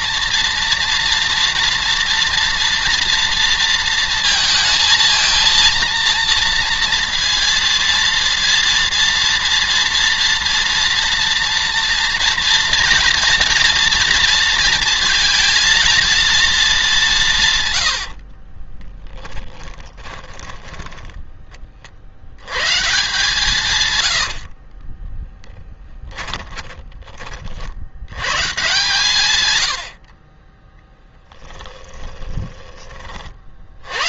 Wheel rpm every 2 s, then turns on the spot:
240, 230, 230, 230, 230, 230, 230, 230, 210, 30, 20, 130, 40, 30, 140, 30, 30.
18-22 24-26 30-32